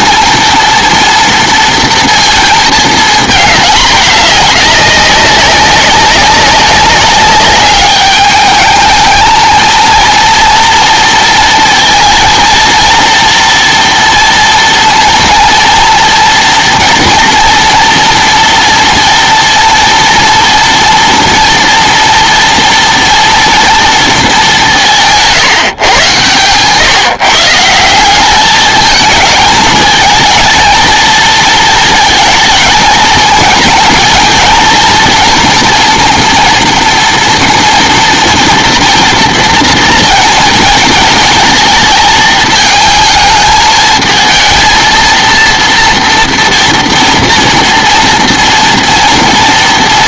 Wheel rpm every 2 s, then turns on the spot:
230, 220, 200, 200, 220, 230, 230, 230, 230, 240, 230, 230, 180, 140, 220, 230, 220, 230, 240, 230, 220, 220, 230, 230, 230.
none